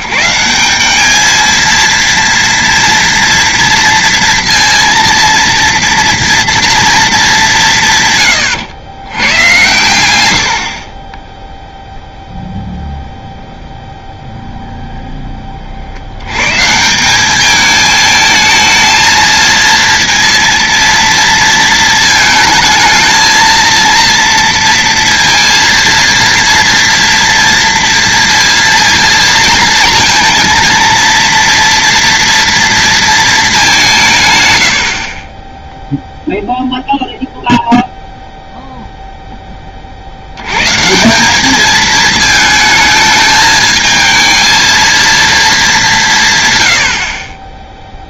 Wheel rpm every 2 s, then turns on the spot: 200, 230, 230, 230, 110, 50, 0, 0, 170, 220, 230, 220, 230, 230, 230, 230, 230, 80, 0, 0, 140, 220, 230, 90.
none